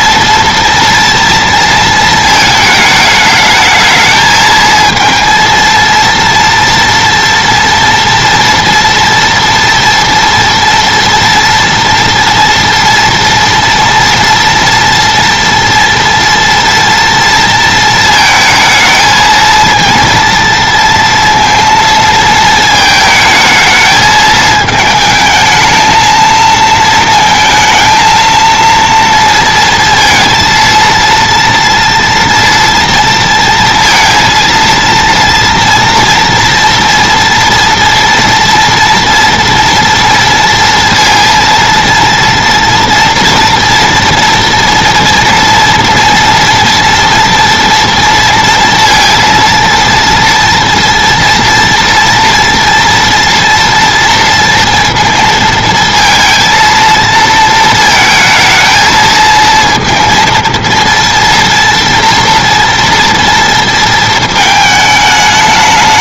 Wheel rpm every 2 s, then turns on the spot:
230, 220, 220, 230, 230, 230, 230, 230, 230, 220, 230, 220, 220, 230, 230, 230, 230, 230, 240, 230, 230, 230, 230, 230, 230, 230, 240, 230, 230, 220, 230, 230, 220.
none